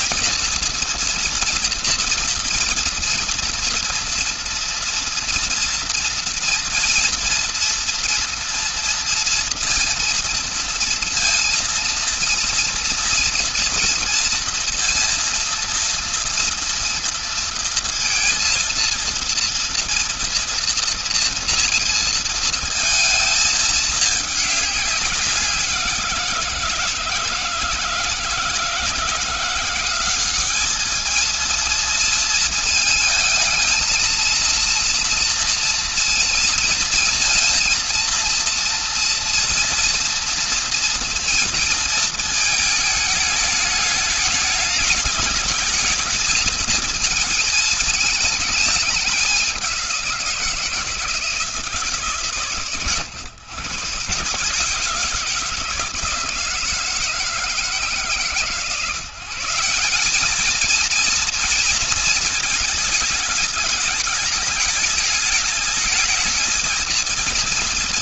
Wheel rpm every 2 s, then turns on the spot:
230, 230, 230, 230, 230, 230, 230, 230, 230, 230, 230, 230, 200, 170, 160, 200, 220, 230, 230, 230, 230, 220, 210, 230, 210, 180, 140, 150, 160, 140, 210, 220, 210, 220.
none